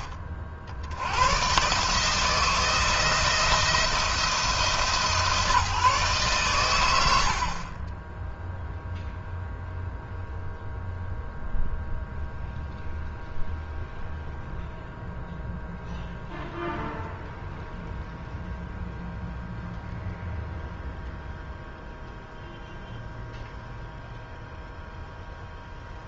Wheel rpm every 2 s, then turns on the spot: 60, 170, 160, 120, 0, 0, 0, 0, 0, 0, 0, 0, 0.
none